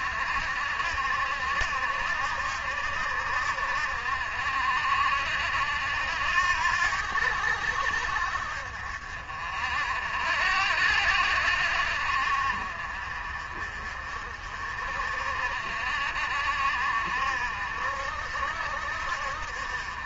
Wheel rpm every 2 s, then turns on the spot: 60, 70, 60, 80, 60, 60, 50, 50, 60, 60.
none